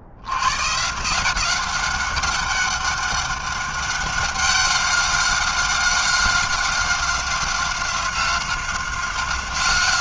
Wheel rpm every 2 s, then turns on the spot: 110, 190, 190, 190, 190.
none